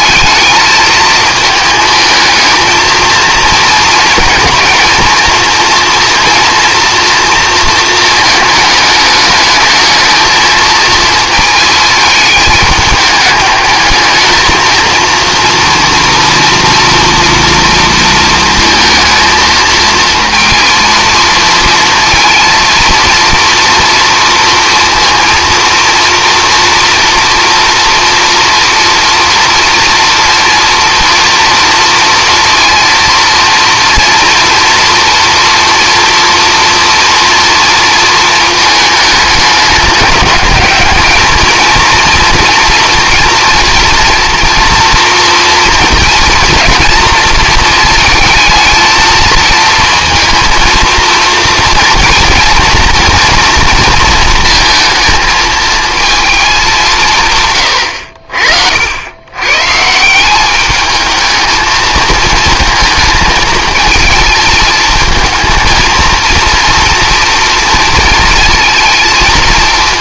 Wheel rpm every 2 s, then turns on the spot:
220, 220, 220, 230, 220, 220, 210, 230, 230, 230, 230, 230, 230, 230, 230, 230, 230, 230, 230, 220, 220, 230, 230, 230, 220, 230, 230, 220, 180, 70, 210, 220, 220, 230, 220.
none